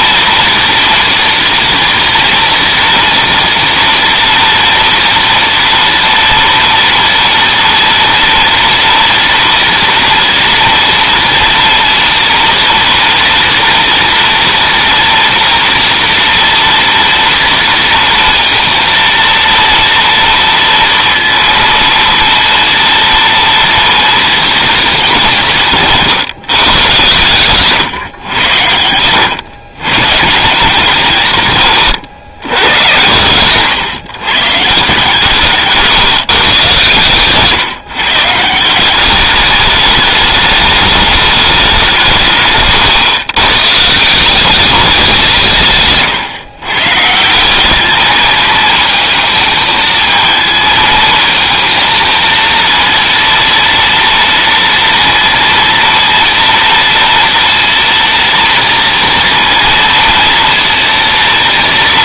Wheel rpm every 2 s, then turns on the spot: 230, 230, 240, 230, 230, 230, 230, 230, 230, 230, 230, 230, 230, 140, 120, 150, 110, 130, 150, 140, 210, 170, 170, 130, 210, 220, 230, 230, 230, 230, 230.
none